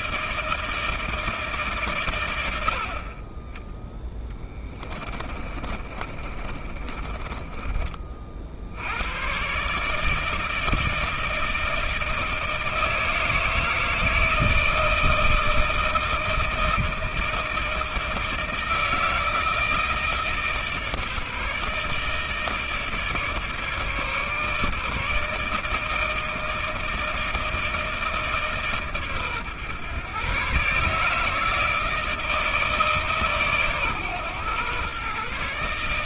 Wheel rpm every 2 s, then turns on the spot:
160, 60, 20, 30, 80, 160, 160, 160, 160, 160, 150, 150, 150, 160, 140, 140, 160, 130.
4-8